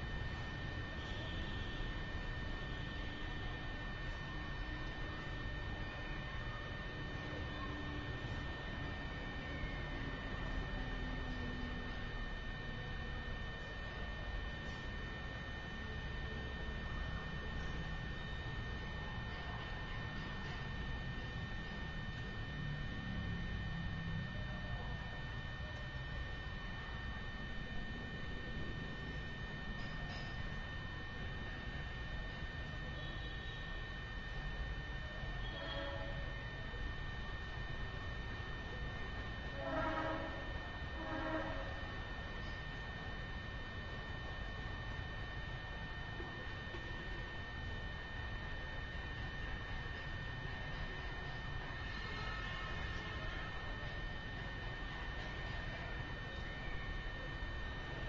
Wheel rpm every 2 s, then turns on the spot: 0, 0, 0, 0, 0, 0, 0, 0, 0, 0, 0, 0, 0, 0, 0, 0, 0, 0, 0, 0, 0, 0, 0, 0, 0, 0, 0, 0, 0.
none